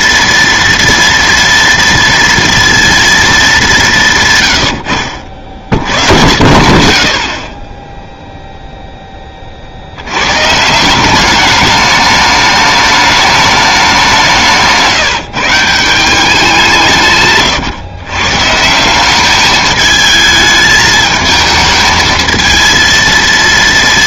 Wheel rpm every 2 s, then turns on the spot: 230, 230, 110, 40, 0, 150, 210, 160, 180, 160, 220, 230.
none